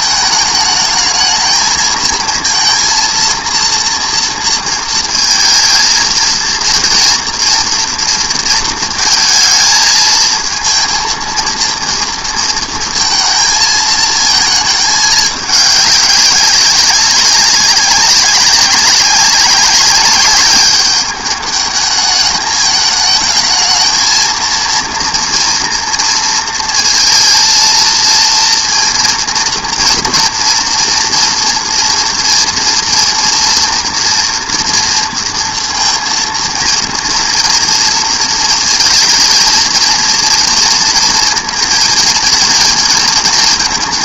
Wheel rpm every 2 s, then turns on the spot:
220, 230, 230, 230, 230, 230, 230, 220, 200, 190, 200, 210, 230, 230, 230, 230, 230, 230, 230, 220, 230, 230.
none